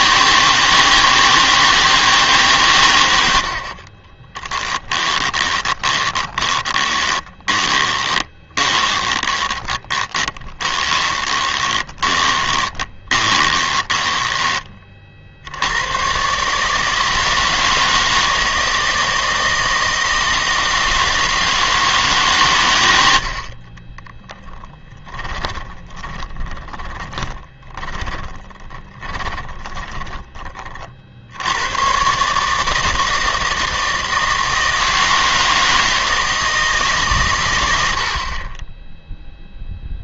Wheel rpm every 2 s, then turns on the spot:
160, 110, 10, 20, 20, 20, 20, 40, 160, 160, 160, 100, 10, 20, 20, 50, 160, 160, 150, 10.
4-14 24-30